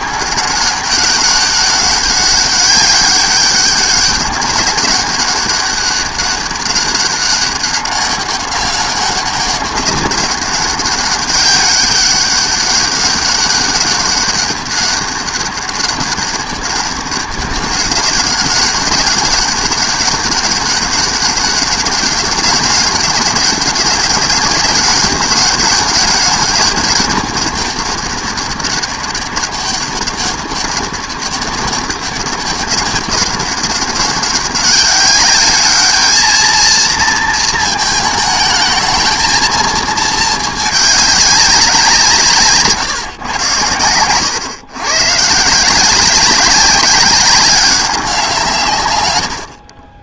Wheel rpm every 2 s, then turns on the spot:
200, 200, 200, 190, 200, 200, 200, 200, 200, 190, 200, 200, 210, 200, 200, 200, 200, 190, 220, 220, 210, 150, 120, 190, 160.
none